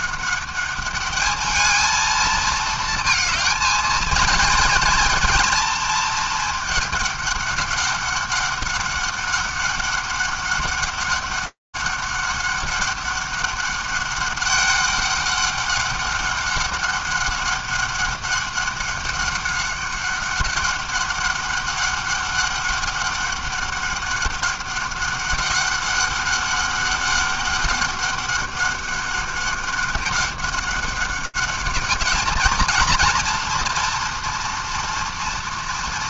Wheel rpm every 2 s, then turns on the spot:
200, 220, 230, 220, 200, 200, 200, 200, 200, 200, 200, 200, 200, 200, 200, 200, 220, 230.
none